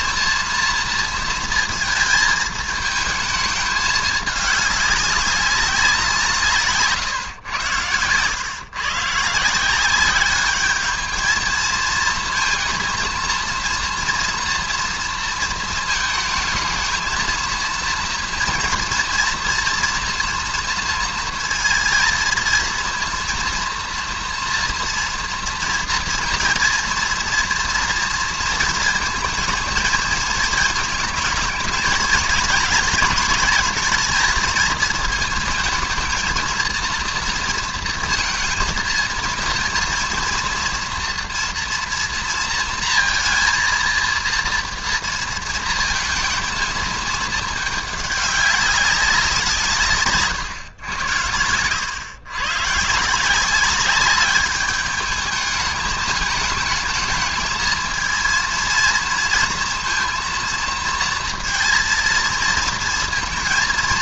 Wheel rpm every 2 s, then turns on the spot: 230, 220, 200, 150, 120, 210, 230, 230, 220, 230, 230, 230, 230, 230, 230, 220, 230, 230, 230, 230, 230, 230, 230, 220, 200, 130, 120, 210, 220, 230, 230, 230.
none